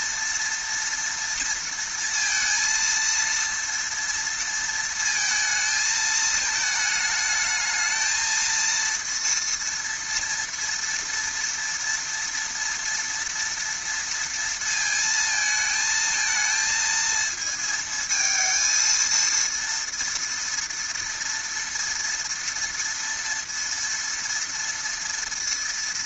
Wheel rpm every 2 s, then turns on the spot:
230, 230, 230, 220, 230, 230, 230, 230, 230, 220, 230, 230, 230.
none